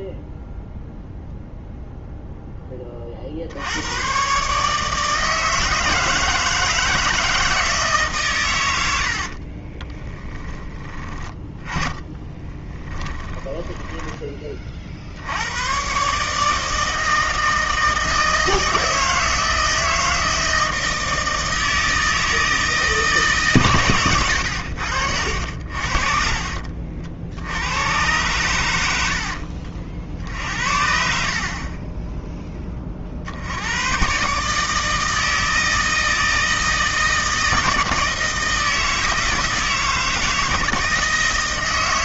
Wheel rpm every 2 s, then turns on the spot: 0, 20, 150, 160, 80, 20, 10, 50, 160, 160, 160, 160, 80, 60, 90, 60, 30, 150, 160, 160, 160.
10-14 24-26